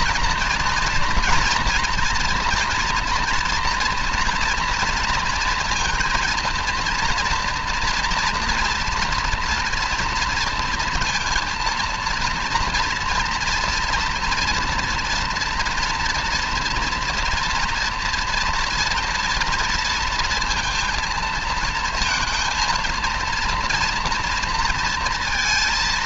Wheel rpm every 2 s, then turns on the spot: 230, 230, 230, 240, 240, 230, 230, 230, 230, 230, 230, 230, 230.
none